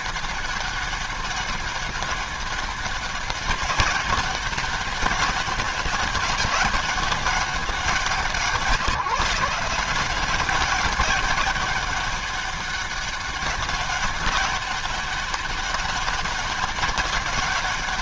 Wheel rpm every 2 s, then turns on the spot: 200, 200, 200, 200, 180, 190, 200, 200, 200.
none